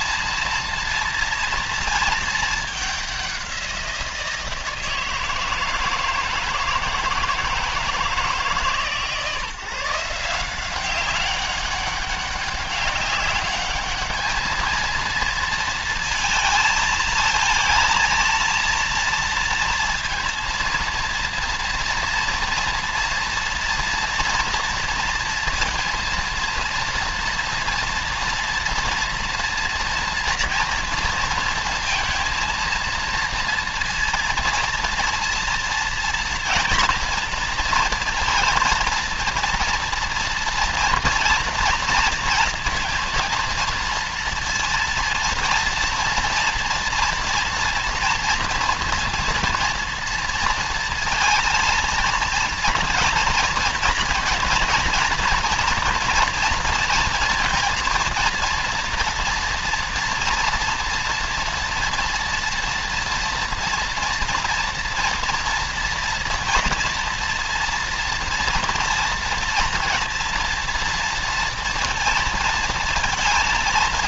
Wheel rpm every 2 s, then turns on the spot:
230, 210, 160, 160, 150, 180, 200, 220, 230, 230, 230, 230, 230, 230, 240, 230, 230, 230, 240, 230, 230, 230, 230, 230, 230, 230, 230, 240, 230, 230, 230, 230, 230, 230, 230, 230, 230.
none